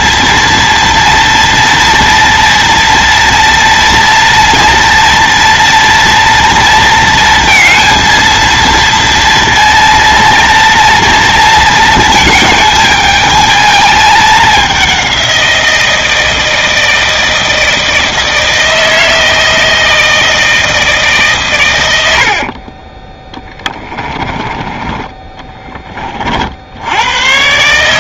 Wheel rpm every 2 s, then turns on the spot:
230, 230, 230, 230, 230, 230, 220, 200, 160, 160, 160, 30, 20, 80.
22-26